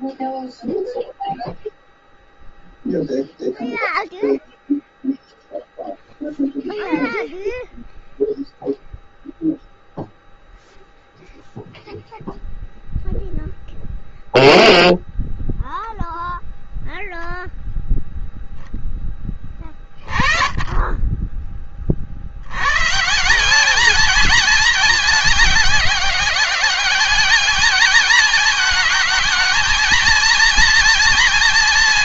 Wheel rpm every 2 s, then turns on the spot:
0, 0, 0, 0, 0, 0, 0, 0, 0, 0, 20, 110, 220, 200, 220, 230.
none